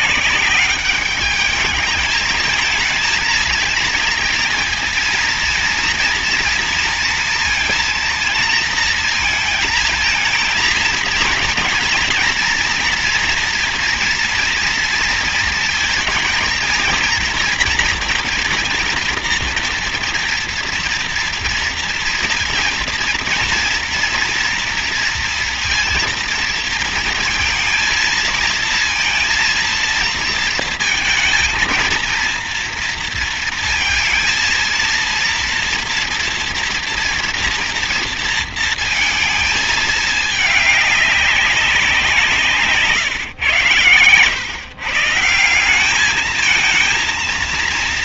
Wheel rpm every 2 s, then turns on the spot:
200, 220, 230, 230, 230, 230, 230, 230, 230, 230, 230, 230, 230, 230, 230, 230, 230, 230, 230, 220, 200, 140, 160, 230.
none